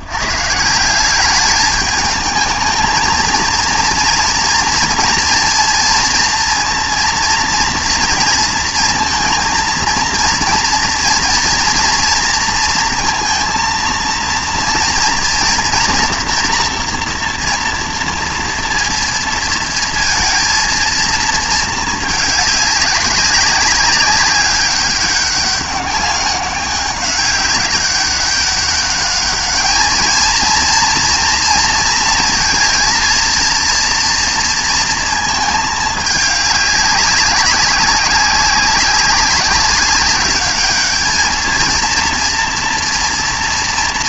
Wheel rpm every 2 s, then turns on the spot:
100, 220, 230, 230, 230, 230, 230, 230, 240, 230, 220, 200, 200, 200, 200, 230, 230, 230, 200, 200, 210, 230.
none